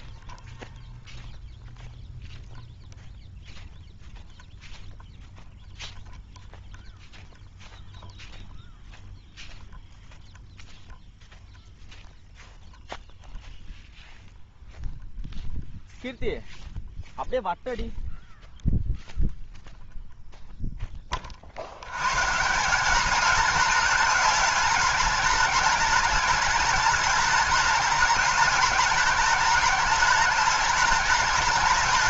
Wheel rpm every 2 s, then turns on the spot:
0, 0, 0, 0, 0, 0, 0, 0, 0, 0, 10, 170, 210, 210, 210, 210.
none